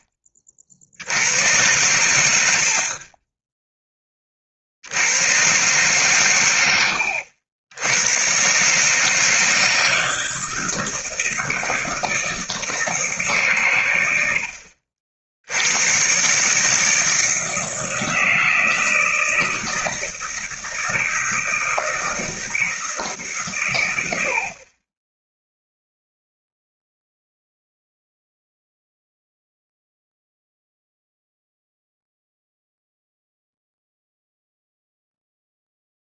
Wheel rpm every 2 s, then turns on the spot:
70, 50, 70, 100, 150, 160, 160, 50, 160, 160, 160, 160, 30, 0, 0, 0, 0, 0.
none